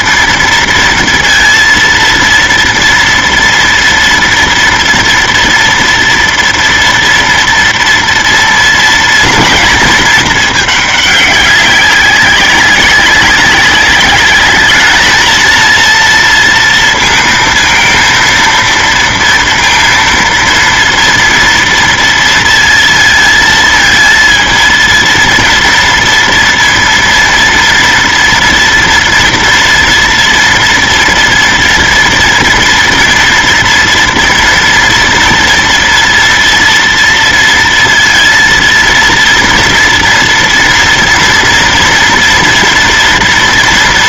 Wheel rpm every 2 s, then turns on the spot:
230, 230, 230, 240, 230, 210, 200, 220, 230, 230, 230, 230, 230, 230, 230, 240, 230, 240, 230, 230, 230, 230.
none